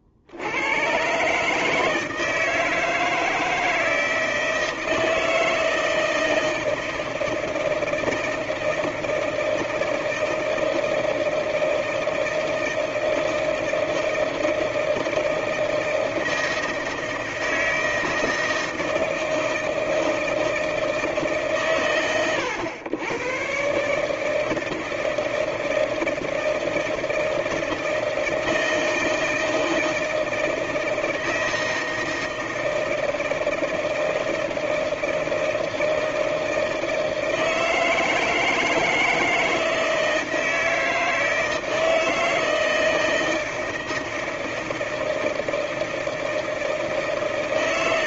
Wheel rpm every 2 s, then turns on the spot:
80, 160, 160, 160, 160, 160, 160, 160, 160, 160, 160, 90, 160, 160, 160, 160, 160, 160, 160, 160, 160, 160, 160, 160.
none